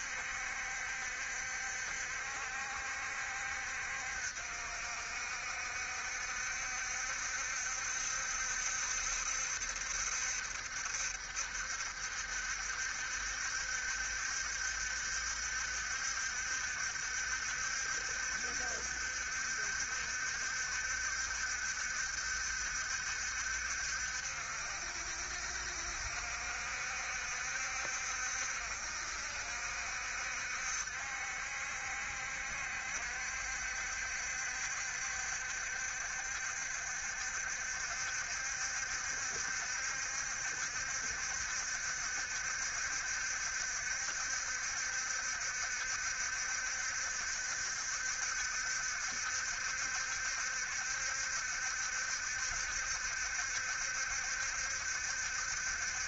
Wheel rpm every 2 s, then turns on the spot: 70, 60, 60, 70, 70, 60, 70, 70, 70, 70, 70, 70, 60, 60, 60, 70, 70, 70, 70, 70, 70, 70, 70, 70, 70, 70, 70, 70.
none